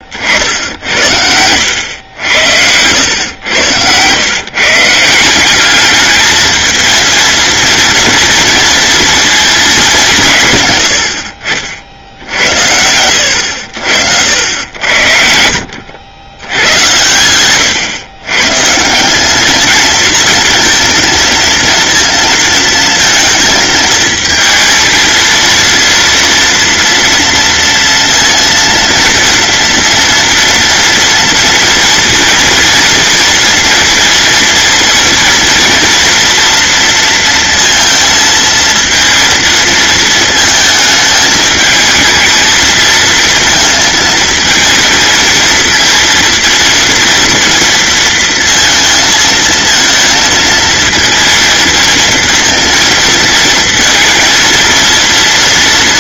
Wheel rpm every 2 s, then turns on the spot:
70, 100, 160, 230, 230, 90, 90, 80, 100, 160, 230, 230, 230, 230, 230, 230, 230, 230, 230, 230, 220, 220, 220, 230, 230, 230, 230, 230.
0-2